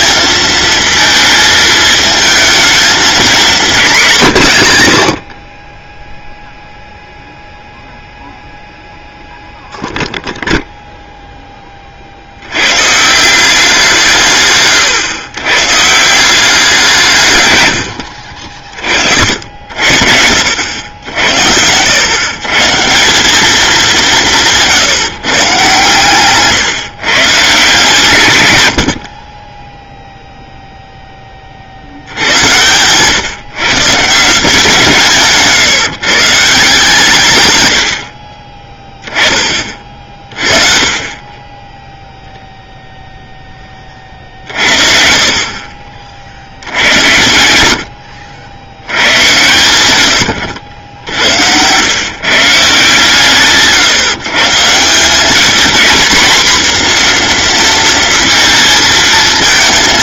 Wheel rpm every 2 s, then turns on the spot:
220, 220, 90, 0, 0, 0, 130, 130, 170, 50, 80, 160, 170, 140, 70, 0, 120, 170, 160, 20, 30, 0, 50, 80, 100, 80, 160, 180, 240, 230.
50-52